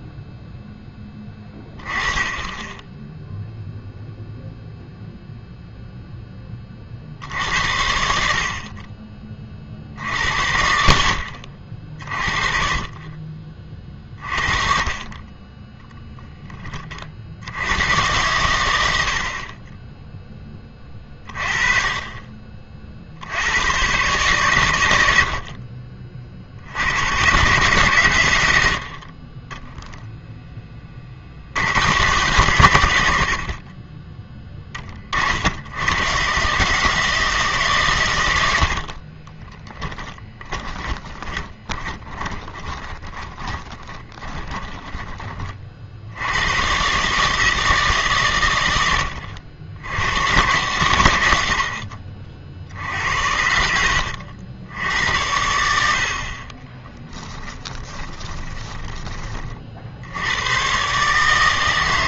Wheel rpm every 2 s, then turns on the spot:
10, 10, 0, 20, 40, 60, 30, 40, 20, 100, 20, 40, 110, 80, 80, 20, 110, 30, 140, 60, 20, 20, 20, 120, 100, 110, 60, 80, 30, 20, 120.
38-46 56-60